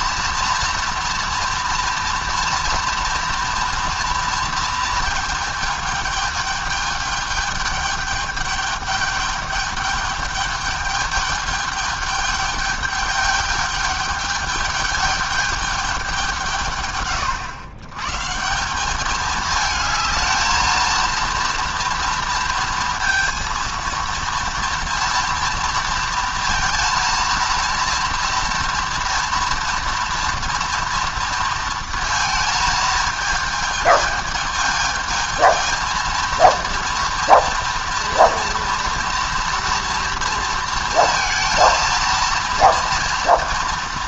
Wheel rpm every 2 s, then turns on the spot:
230, 230, 230, 220, 210, 210, 210, 210, 140, 190, 220, 230, 230, 230, 230, 240, 220, 220, 230, 230, 230, 230.
none